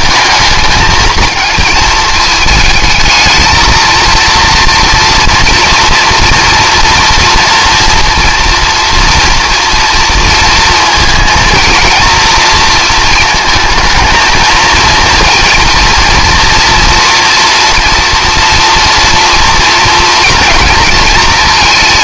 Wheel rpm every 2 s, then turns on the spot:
220, 220, 230, 230, 230, 230, 230, 230, 230, 240, 230.
none